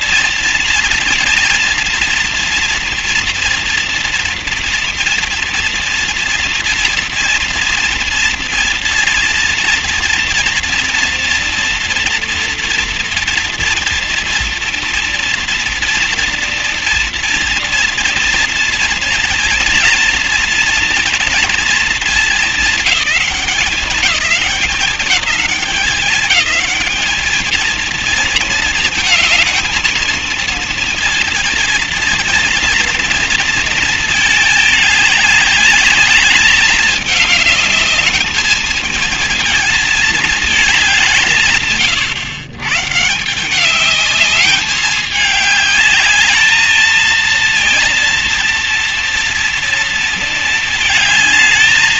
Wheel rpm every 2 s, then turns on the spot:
230, 240, 230, 230, 230, 230, 230, 230, 230, 230, 230, 210, 190, 220, 220, 230, 230, 200, 210, 220, 160, 160, 200, 220, 240, 220.
none